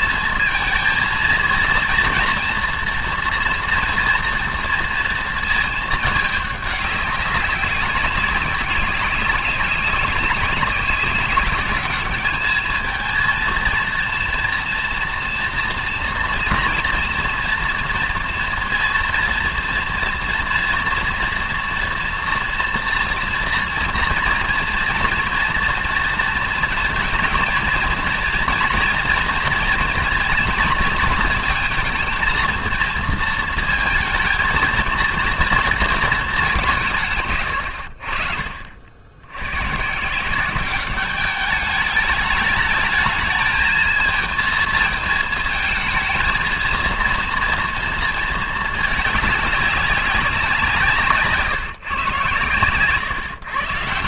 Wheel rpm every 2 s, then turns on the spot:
230, 230, 230, 210, 200, 190, 220, 230, 230, 230, 240, 230, 230, 230, 230, 230, 230, 220, 190, 60, 180, 210, 220, 230, 220, 180, 110.
none